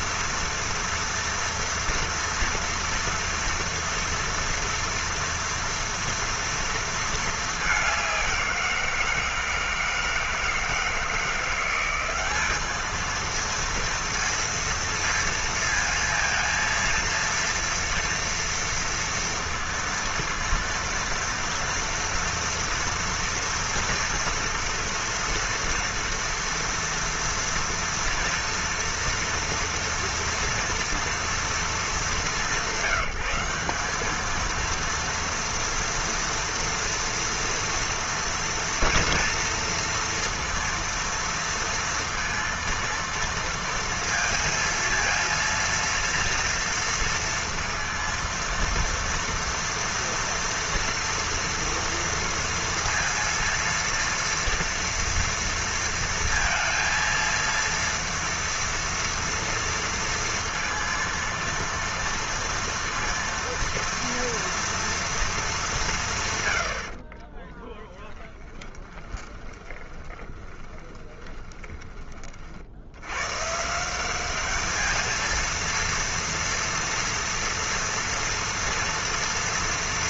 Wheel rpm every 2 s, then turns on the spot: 230, 230, 230, 230, 170, 160, 210, 230, 230, 230, 230, 230, 240, 230, 230, 230, 170, 230, 230, 230, 230, 230, 230, 230, 230, 230, 230, 230, 230, 230, 230, 230, 230, 80, 10, 20, 70, 210, 230, 230.
68-72